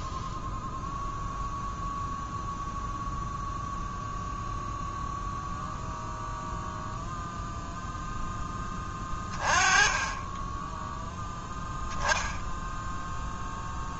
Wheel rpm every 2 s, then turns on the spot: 0, 0, 0, 0, 20, 0, 0.
none